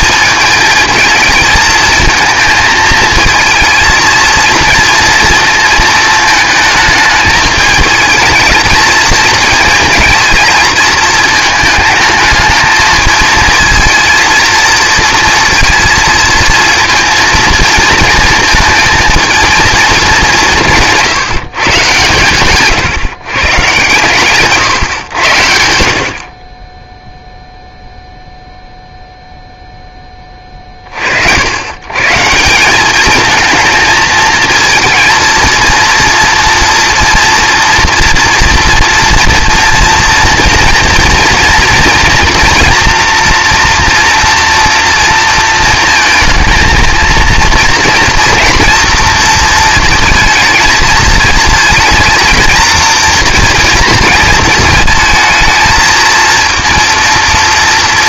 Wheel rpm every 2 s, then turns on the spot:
220, 220, 230, 220, 220, 230, 220, 230, 230, 220, 180, 130, 140, 20, 0, 40, 180, 230, 240, 240, 230, 230, 230, 230, 230, 230, 230, 220, 230.
none